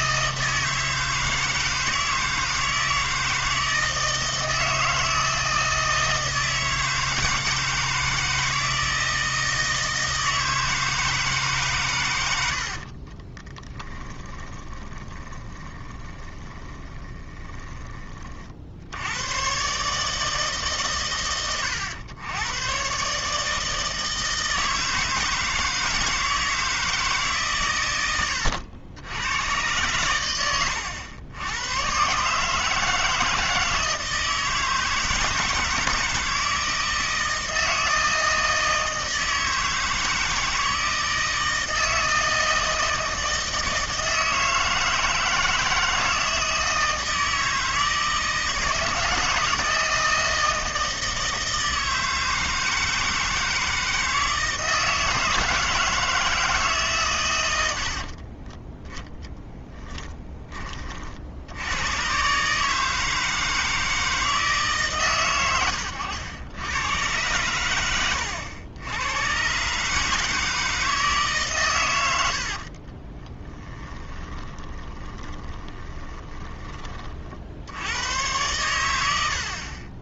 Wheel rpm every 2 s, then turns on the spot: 160, 160, 160, 160, 160, 160, 50, 20, 20, 70, 110, 130, 160, 160, 90, 90, 160, 160, 160, 160, 160, 160, 160, 160, 160, 160, 160, 160, 150, 10, 40, 160, 150, 100, 90, 160, 40, 20, 40, 90.
12-18 72-76